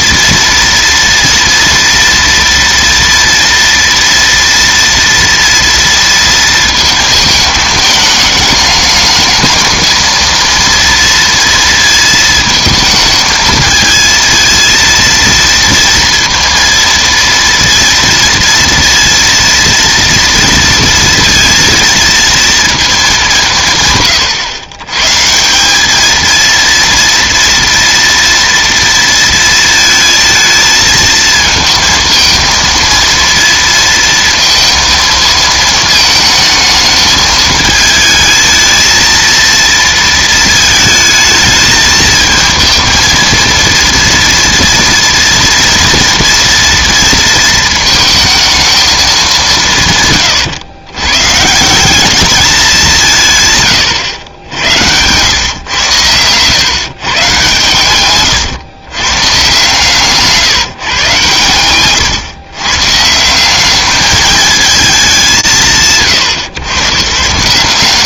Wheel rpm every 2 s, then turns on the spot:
230, 230, 230, 230, 210, 230, 220, 230, 230, 230, 230, 230, 120, 230, 230, 220, 230, 230, 220, 220, 220, 230, 230, 230, 220, 110, 190, 80, 130, 120, 150, 130, 210, 130.
none